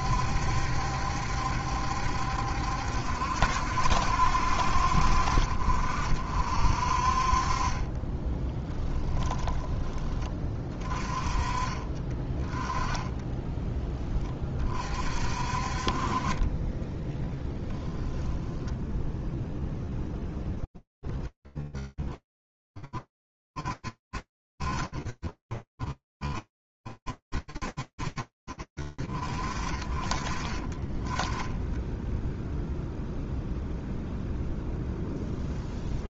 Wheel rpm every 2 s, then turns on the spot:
70, 70, 60, 50, 10, 20, 20, 20, 30, 10, 20, 40, 10, 0, 0, 0, 0, 0.
8-10 12-14 18-20